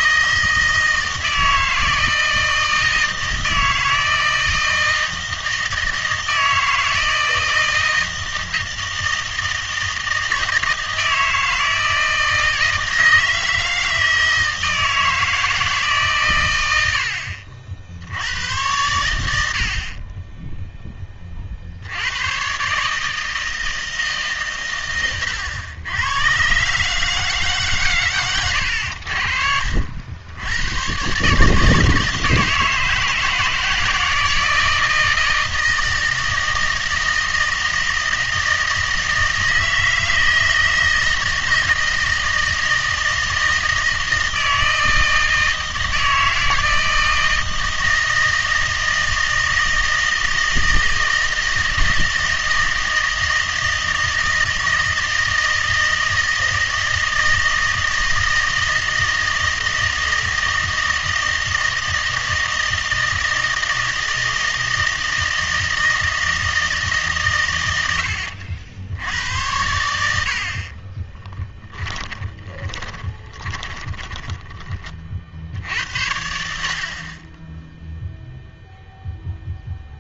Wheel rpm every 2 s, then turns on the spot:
160, 160, 170, 160, 160, 160, 160, 160, 90, 100, 10, 150, 120, 150, 70, 110, 160, 160, 160, 160, 160, 160, 160, 160, 160, 160, 160, 160, 160, 160, 160, 160, 160, 140, 80, 30, 20, 20, 60, 0.
70-74